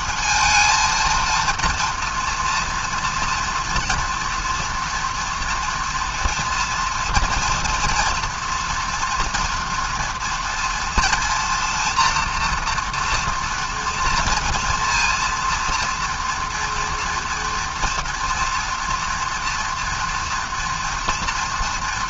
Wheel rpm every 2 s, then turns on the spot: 230, 230, 230, 230, 230, 230, 240, 230, 230, 230, 230.
none